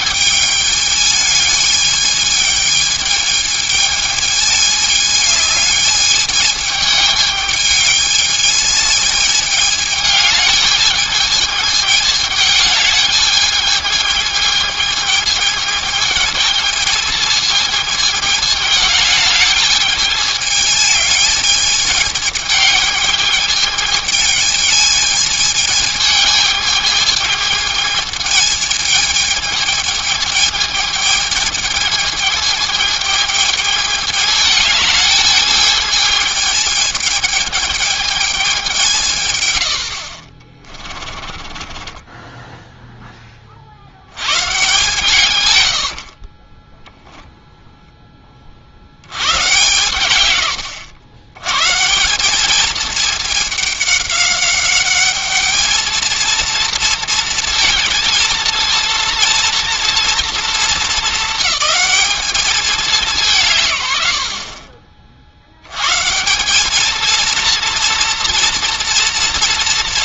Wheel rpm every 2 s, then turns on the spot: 210, 210, 210, 210, 210, 210, 210, 220, 220, 210, 210, 210, 220, 220, 220, 220, 220, 210, 210, 170, 30, 10, 140, 10, 60, 90, 220, 200, 230, 230, 210, 200, 50, 210, 240.
40-42